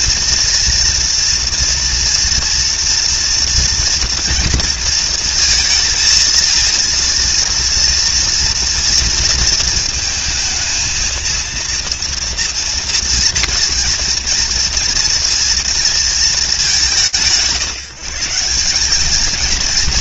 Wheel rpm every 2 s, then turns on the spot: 230, 230, 230, 230, 230, 220, 230, 230, 190, 210.
none